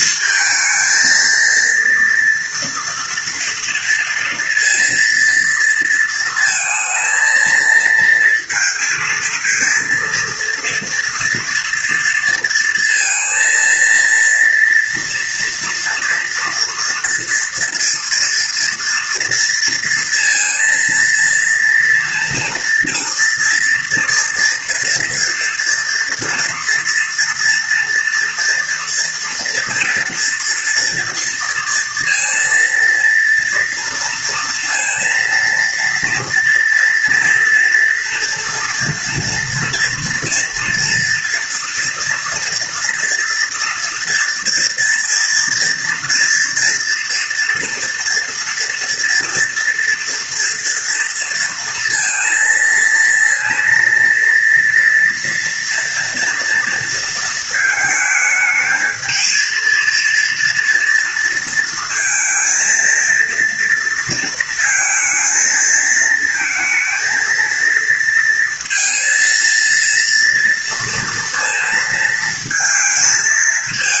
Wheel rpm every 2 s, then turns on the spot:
230, 230, 230, 230, 230, 230, 230, 230, 230, 230, 230, 230, 230, 240, 230, 240, 230, 230, 230, 230, 230, 240, 230, 230, 230, 230, 230, 230, 230, 220, 240, 230, 230, 220, 230, 230, 230.
none